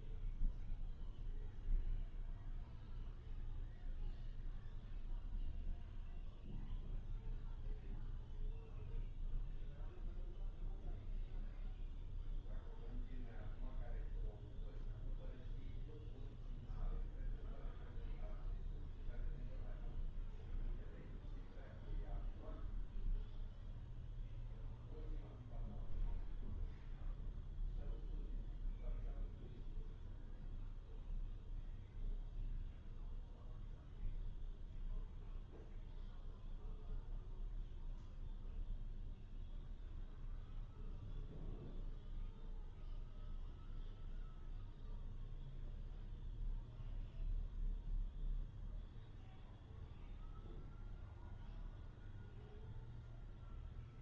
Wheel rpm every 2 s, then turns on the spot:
0, 0, 0, 0, 0, 0, 0, 0, 0, 0, 0, 0, 0, 0, 0, 0, 0, 0, 0, 0, 0, 0, 0, 0, 0, 0, 0.
none